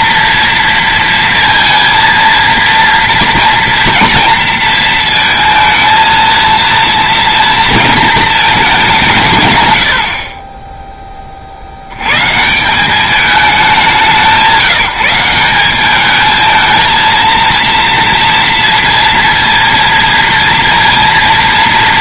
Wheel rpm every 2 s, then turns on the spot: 230, 230, 230, 230, 210, 10, 170, 170, 220, 230, 230.
none